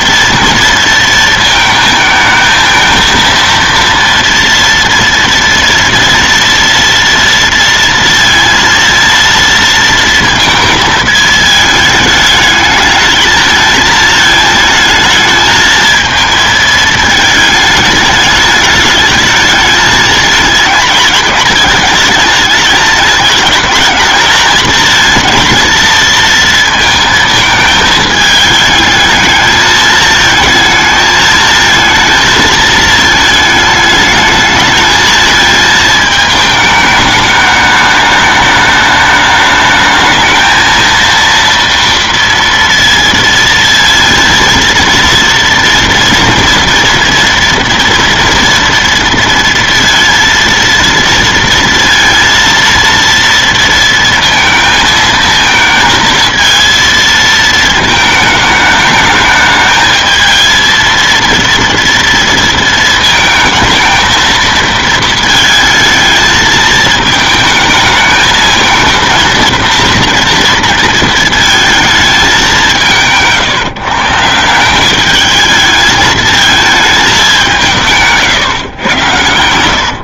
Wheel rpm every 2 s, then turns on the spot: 230, 220, 230, 230, 230, 220, 220, 220, 220, 210, 220, 220, 220, 230, 220, 220, 220, 220, 210, 210, 230, 230, 230, 230, 230, 230, 230, 230, 230, 220, 230, 230, 230, 220, 220, 230, 180, 180, 220, 120.
none